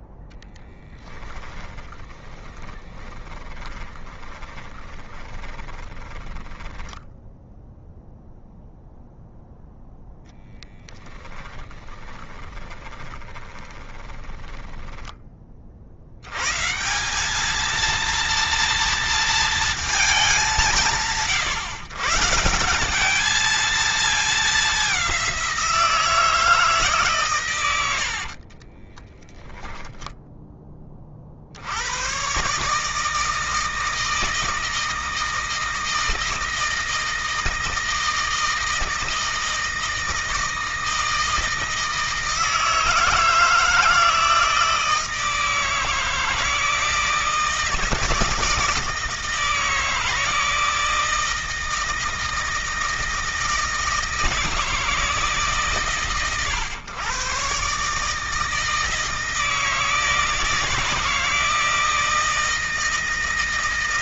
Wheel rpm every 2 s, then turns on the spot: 20, 20, 20, 10, 0, 10, 20, 10, 150, 230, 170, 180, 200, 150, 30, 20, 150, 160, 160, 160, 160, 160, 160, 160, 170, 160, 160, 160, 110, 160, 160, 160.
0-8 10-16 28-30